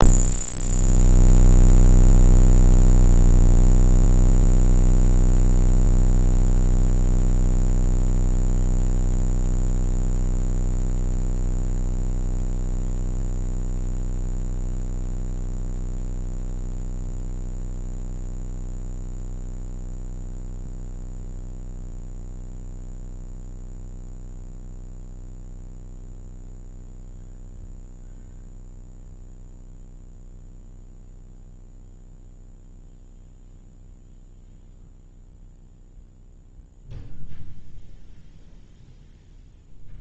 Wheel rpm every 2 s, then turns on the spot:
0, 0, 0, 0, 0, 0, 0, 0, 0, 0, 0, 0, 0, 0, 0, 0, 0, 0, 0, 0.
none